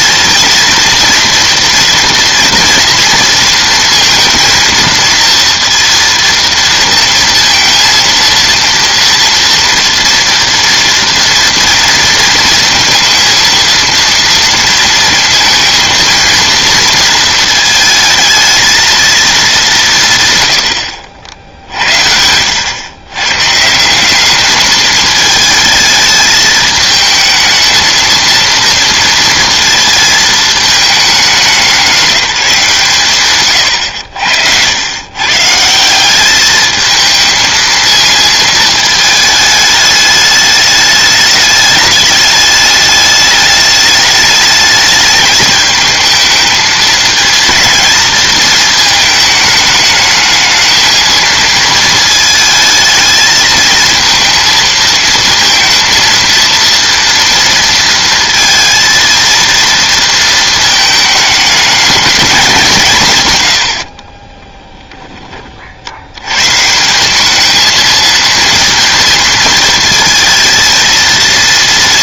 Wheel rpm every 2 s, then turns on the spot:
230, 230, 230, 230, 230, 230, 230, 230, 230, 220, 70, 110, 210, 220, 230, 210, 160, 100, 220, 220, 210, 210, 220, 220, 220, 220, 220, 230, 230, 230, 220, 160, 20, 150, 230, 230.
20-22 64-66